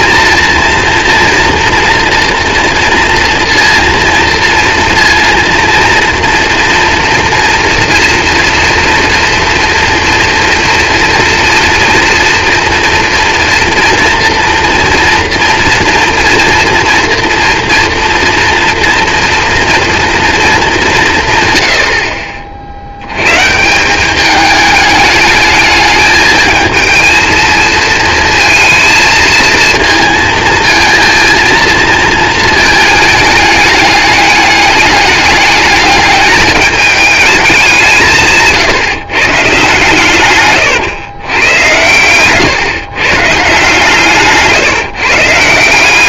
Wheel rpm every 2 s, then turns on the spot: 230, 230, 230, 230, 230, 230, 230, 230, 230, 230, 210, 60, 210, 220, 220, 230, 220, 210, 210, 140, 130, 130, 150.
40-42